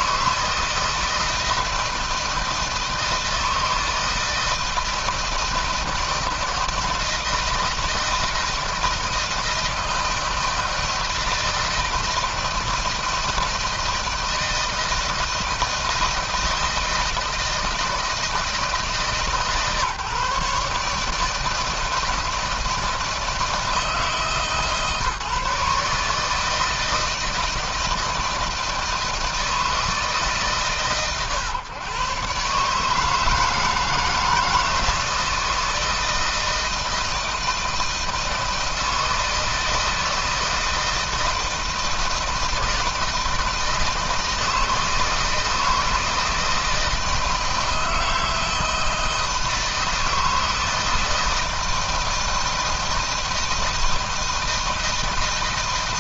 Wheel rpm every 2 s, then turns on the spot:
160, 160, 160, 160, 160, 160, 160, 160, 160, 150, 150, 160, 150, 160, 160, 120, 150, 160, 160, 160, 160, 160, 160, 160, 160, 160, 160, 160.
none